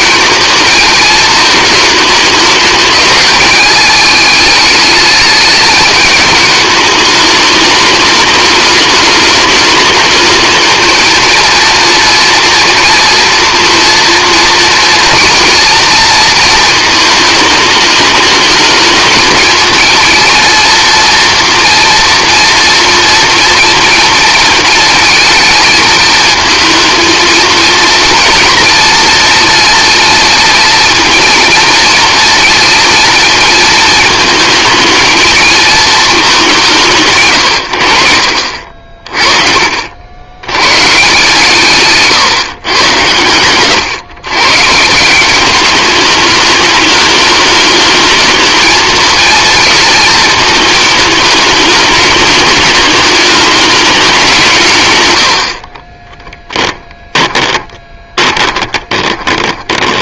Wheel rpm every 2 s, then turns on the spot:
220, 220, 210, 210, 210, 220, 230, 230, 220, 220, 230, 230, 220, 230, 230, 230, 230, 220, 150, 50, 130, 120, 160, 210, 220, 220, 210, 130, 10, 20.
38-40 54-60